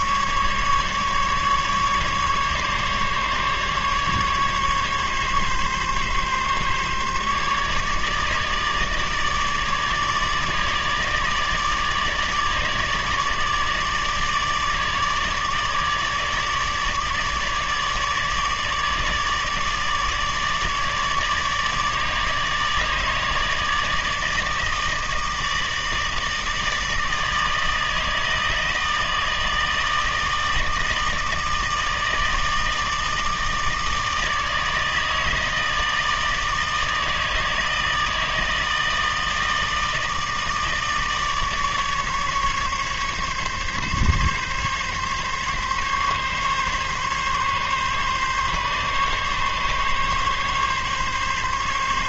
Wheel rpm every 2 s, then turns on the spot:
150, 150, 140, 140, 150, 150, 150, 150, 150, 150, 150, 150, 160, 160, 160, 160, 150, 160, 160, 160, 150, 140, 140, 140, 140, 140.
none